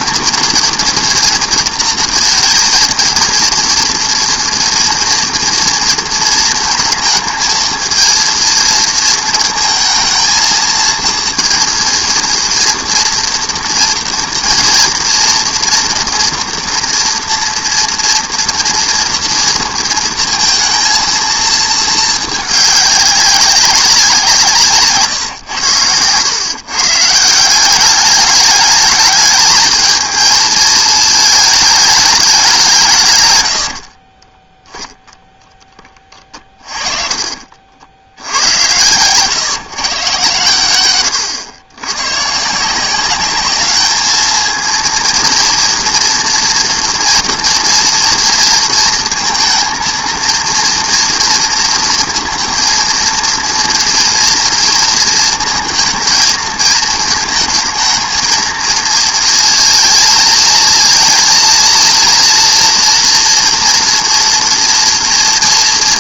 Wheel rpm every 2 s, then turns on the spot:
240, 230, 230, 220, 230, 220, 230, 230, 230, 230, 230, 210, 160, 130, 210, 220, 180, 10, 30, 100, 110, 160, 230, 230, 230, 240, 230, 230, 220, 230, 230, 230, 240.
36-38